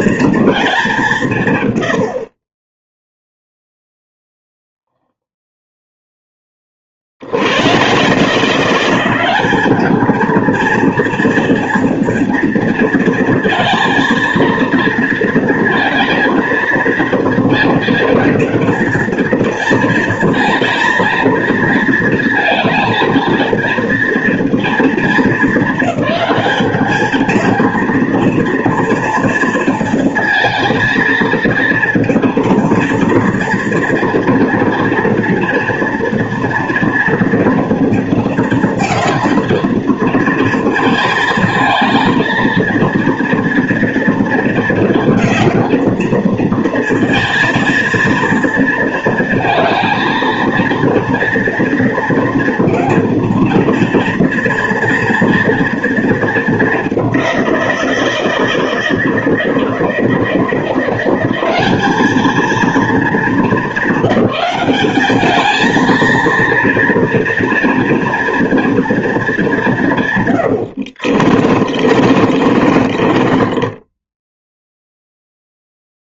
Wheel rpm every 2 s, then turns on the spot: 220, 20, 0, 30, 170, 230, 230, 230, 230, 230, 230, 220, 230, 210, 230, 230, 230, 230, 230, 220, 230, 230, 230, 230, 230, 230, 230, 230, 210, 170, 170, 220, 200, 230, 230, 80, 40, 0.
70-74